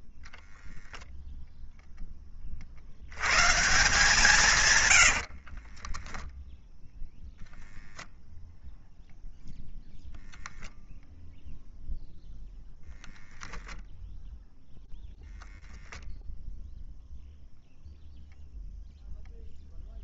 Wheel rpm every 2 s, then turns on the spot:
0, 70, 120, 0, 0, 0, 0, 0, 0, 0.
none